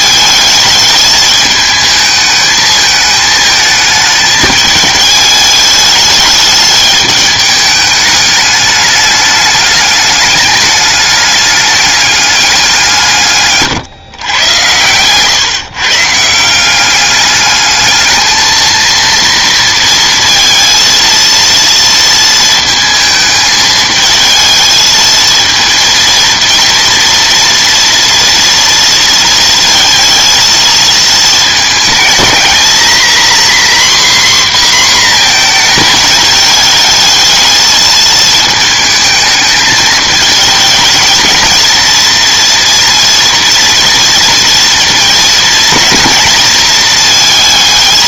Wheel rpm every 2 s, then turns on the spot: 210, 220, 220, 210, 210, 210, 190, 110, 180, 230, 230, 220, 220, 230, 230, 230, 230, 250, 220, 220, 220, 230, 220, 220.
none